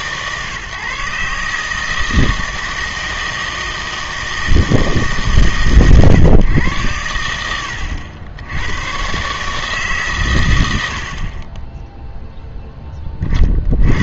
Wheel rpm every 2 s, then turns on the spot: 140, 160, 160, 120, 100, 110, 0.
none